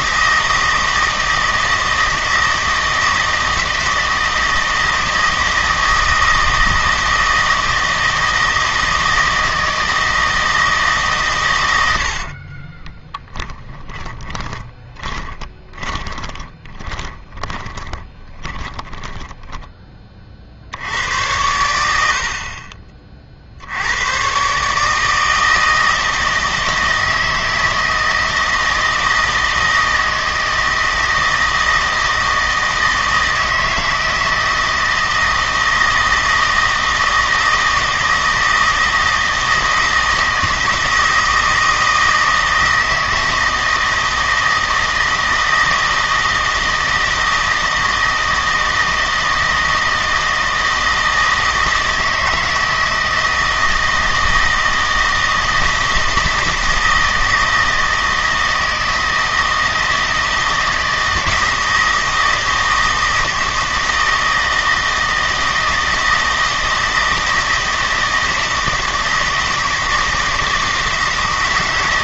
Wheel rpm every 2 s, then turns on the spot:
160, 160, 160, 160, 160, 160, 30, 20, 10, 20, 70, 40, 150, 160, 160, 160, 160, 160, 160, 160, 160, 160, 160, 160, 160, 160, 160, 160, 160, 160, 160, 160, 160, 160, 160, 160.
12-20